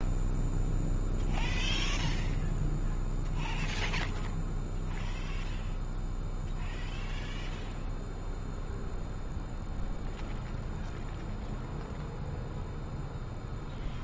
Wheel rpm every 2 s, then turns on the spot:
0, 0, 0, 0, 0, 0, 0.
none